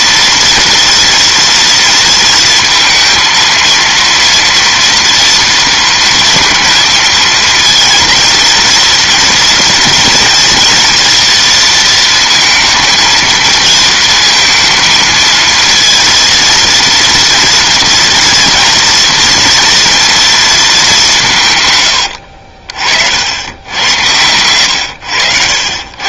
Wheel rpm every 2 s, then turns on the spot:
230, 230, 230, 220, 230, 230, 230, 230, 230, 230, 210, 60, 90.
none